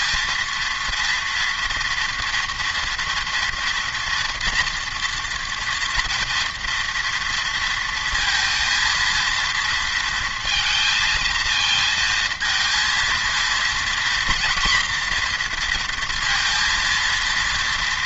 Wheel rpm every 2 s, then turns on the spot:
230, 230, 240, 230, 230, 230, 230, 240, 230.
none